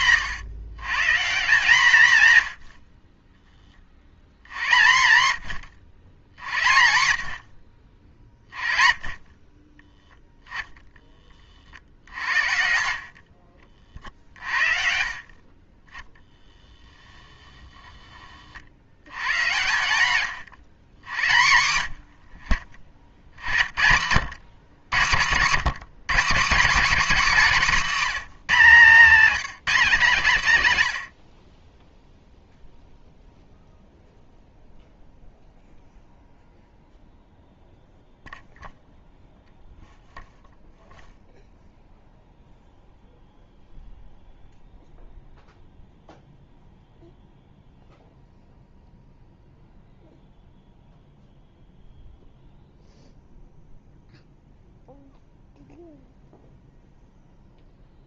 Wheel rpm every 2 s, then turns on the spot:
140, 70, 120, 70, 30, 10, 60, 40, 10, 70, 120, 50, 110, 210, 200, 130, 0, 0, 0, 0, 0, 0, 0, 0, 0, 0, 0, 0, 0.
16-18